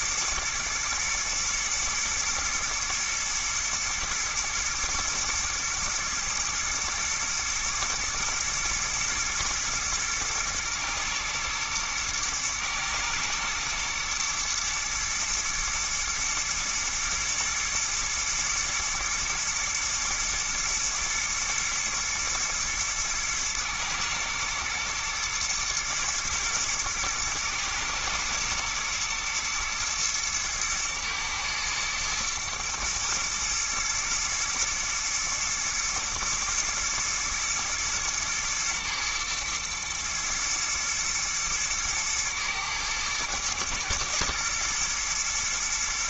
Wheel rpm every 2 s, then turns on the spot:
110, 120, 110, 110, 120, 120, 110, 110, 110, 120, 110, 110, 110, 110, 110, 110, 110, 120, 110, 110, 110, 110, 120.
none